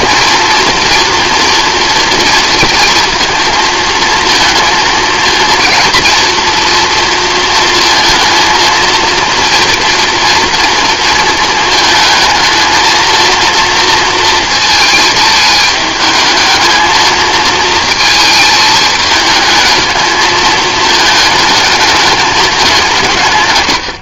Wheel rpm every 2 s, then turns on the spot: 230, 230, 230, 230, 230, 230, 220, 230, 220, 220, 220, 190.
none